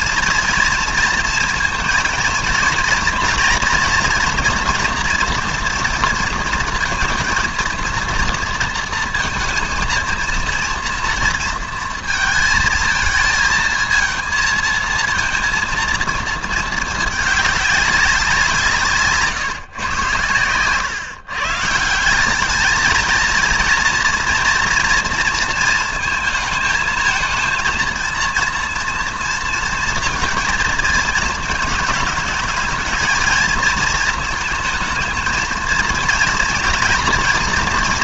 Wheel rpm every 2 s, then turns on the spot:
230, 230, 230, 230, 230, 230, 230, 220, 220, 170, 120, 210, 230, 230, 230, 230, 220, 220, 230.
20-22